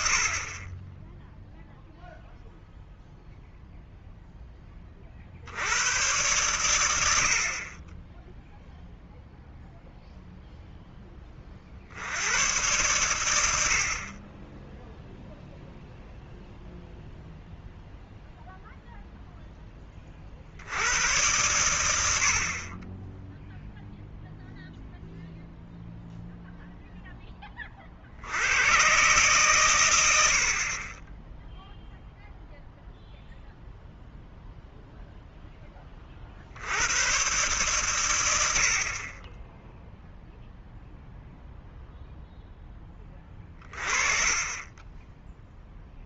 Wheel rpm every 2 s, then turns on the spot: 30, 0, 20, 100, 0, 0, 120, 10, 0, 0, 70, 30, 0, 0, 110, 40, 0, 0, 80, 60, 0, 10, 20.
none